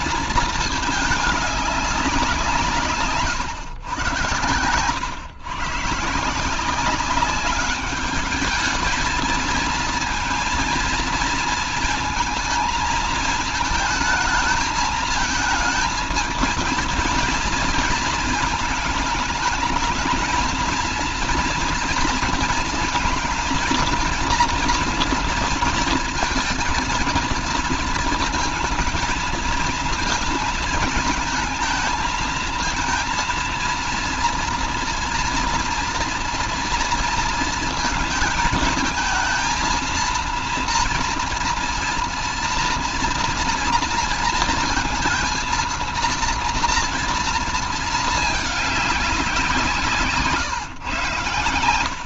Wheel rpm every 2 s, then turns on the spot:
220, 150, 100, 180, 220, 230, 220, 220, 220, 220, 230, 230, 230, 230, 230, 220, 230, 230, 230, 220, 230, 230, 230, 230, 210, 130.
none